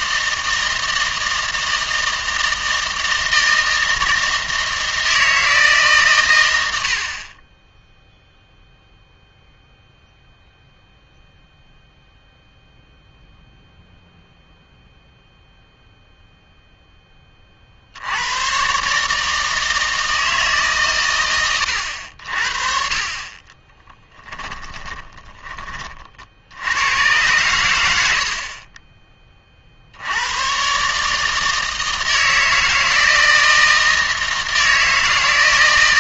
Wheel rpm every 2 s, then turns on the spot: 160, 160, 160, 90, 0, 0, 0, 0, 0, 130, 140, 40, 10, 90, 40, 130, 160, 160.
24-26